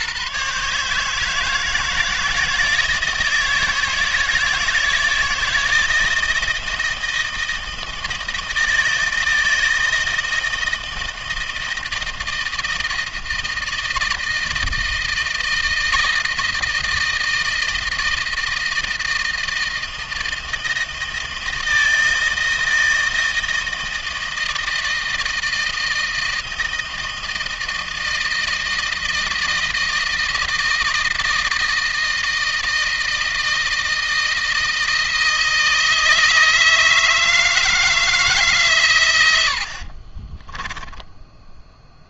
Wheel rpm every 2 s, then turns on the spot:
150, 160, 160, 160, 160, 160, 160, 160, 160, 160, 160, 160, 160, 160, 160, 160, 160, 160, 160, 130, 10.
40-42